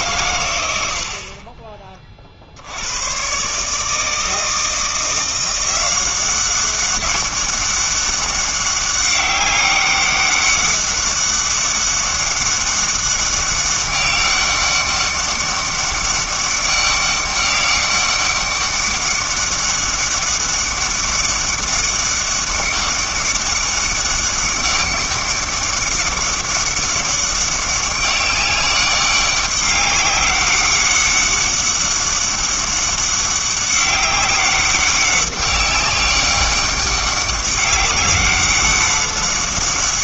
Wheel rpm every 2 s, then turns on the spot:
90, 80, 160, 190, 200, 200, 200, 200, 200, 200, 200, 200, 200, 200, 200, 200, 200, 190, 200, 200.
none